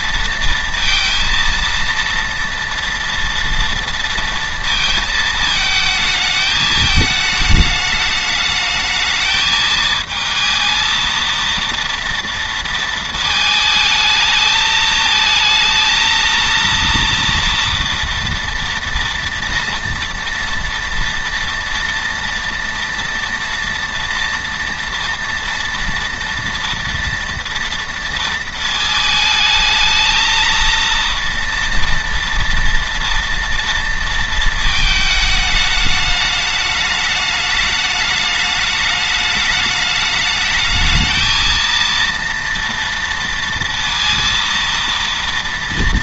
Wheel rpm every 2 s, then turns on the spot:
230, 230, 230, 220, 220, 220, 230, 220, 230, 230, 240, 230, 230, 230, 220, 230, 230, 220, 220, 210, 220, 230, 230.
none